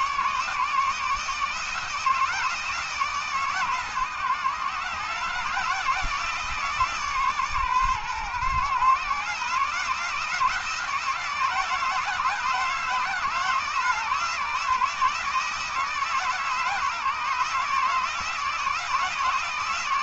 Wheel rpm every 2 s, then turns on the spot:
150, 160, 140, 160, 130, 160, 160, 160, 150, 160.
none